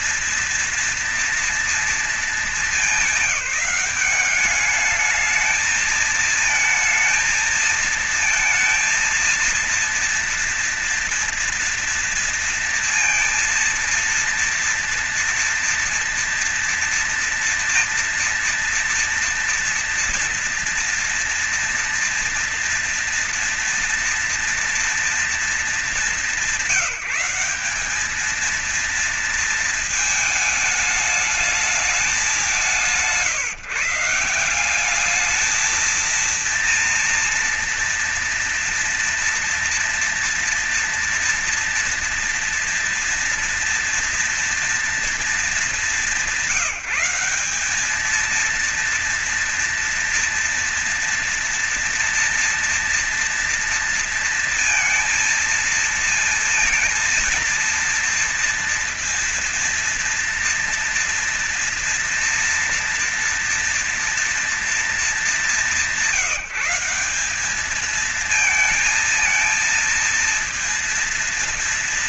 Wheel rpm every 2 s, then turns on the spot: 230, 210, 210, 220, 230, 230, 230, 230, 230, 240, 230, 230, 230, 190, 230, 220, 180, 200, 230, 240, 230, 230, 230, 180, 230, 230, 240, 230, 230, 230, 240, 230, 220, 180, 230, 230.
none